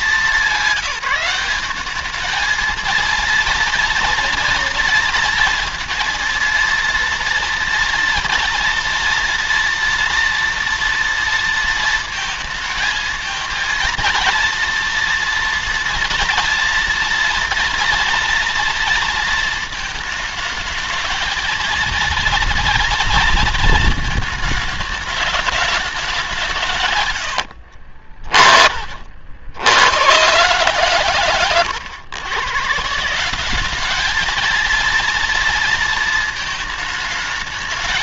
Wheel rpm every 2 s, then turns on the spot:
190, 220, 230, 230, 230, 230, 220, 230, 230, 230, 220, 230, 220, 150, 40, 130, 140, 220, 220.
none